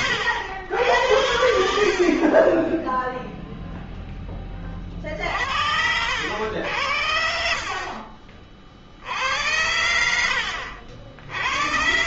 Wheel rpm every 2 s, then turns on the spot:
70, 0, 50, 50, 80, 70.
6-8